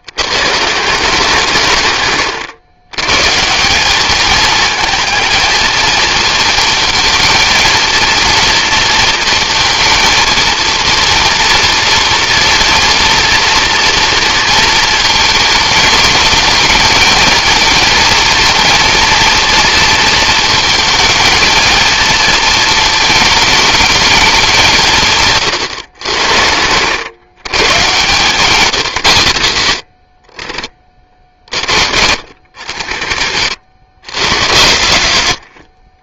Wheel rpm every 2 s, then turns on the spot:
150, 100, 220, 230, 230, 230, 230, 230, 210, 230, 220, 230, 190, 80, 160, 60, 80, 100.
none